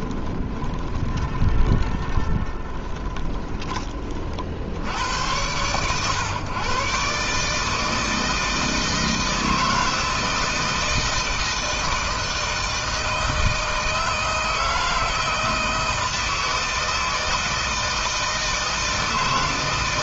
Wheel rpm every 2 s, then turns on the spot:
20, 20, 70, 130, 160, 160, 160, 160, 160, 160.
0-4